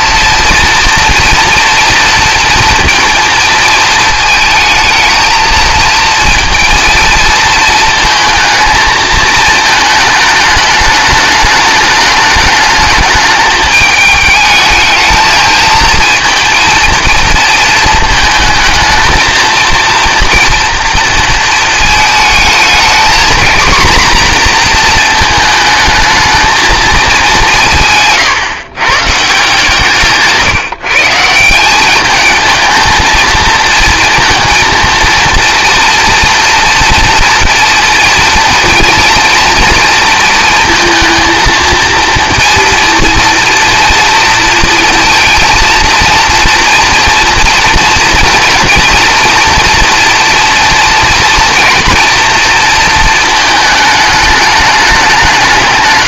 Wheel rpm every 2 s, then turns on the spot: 230, 230, 220, 230, 220, 210, 210, 220, 230, 220, 230, 220, 240, 220, 120, 150, 220, 230, 230, 230, 230, 230, 230, 230, 230, 230, 230, 210.
none